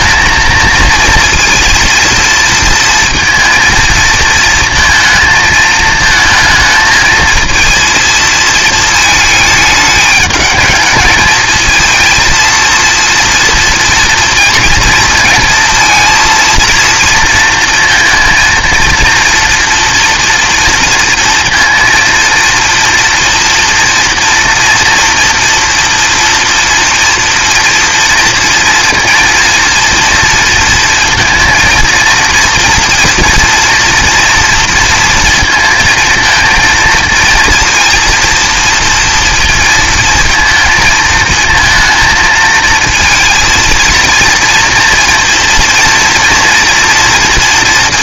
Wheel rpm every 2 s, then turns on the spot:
220, 230, 230, 220, 230, 220, 230, 230, 230, 230, 230, 230, 230, 230, 230, 230, 230, 230, 230, 230, 220, 230, 230, 240.
none